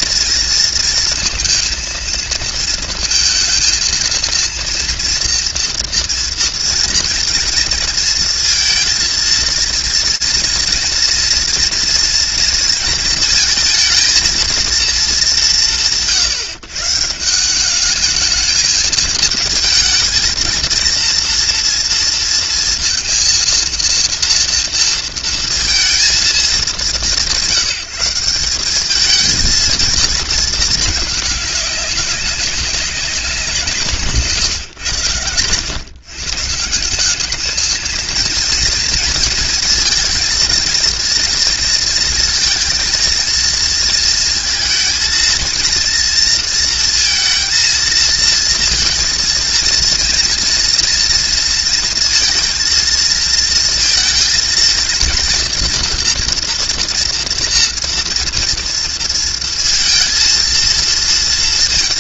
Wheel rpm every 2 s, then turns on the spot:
230, 230, 230, 230, 230, 230, 220, 190, 170, 220, 230, 230, 230, 170, 220, 200, 180, 100, 210, 230, 230, 230, 230, 230, 230, 230, 230, 230, 230, 230, 230.
none